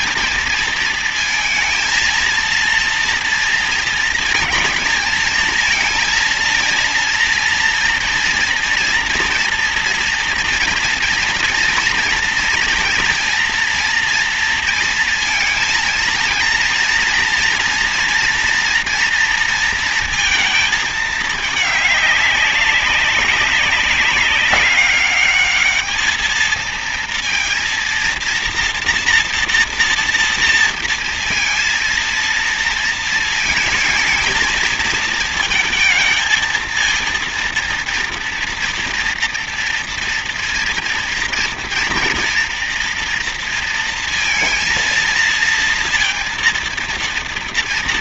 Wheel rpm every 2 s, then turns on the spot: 220, 230, 220, 230, 230, 230, 230, 230, 230, 230, 220, 200, 200, 230, 230, 230, 230, 230, 230, 240, 230, 240, 230, 230.
none